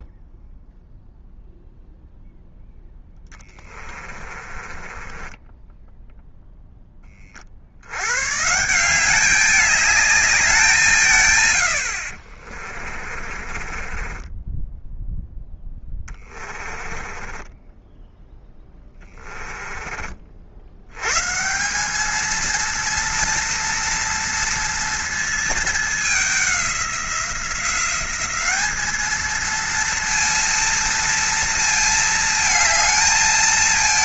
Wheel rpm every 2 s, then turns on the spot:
0, 0, 20, 0, 160, 190, 40, 10, 20, 10, 80, 230, 230, 190, 210, 230, 220.
4-6 12-20